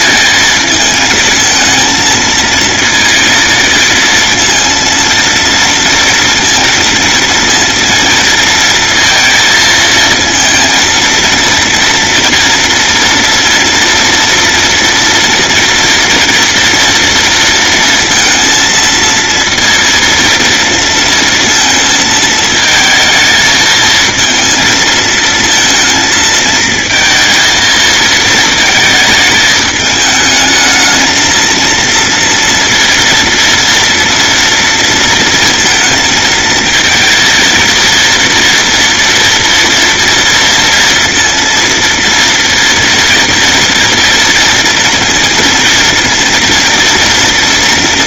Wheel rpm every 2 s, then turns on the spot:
220, 230, 230, 230, 230, 230, 240, 230, 230, 230, 230, 220, 220, 230, 220, 220, 230, 230, 230, 230, 230, 230, 230, 230.
none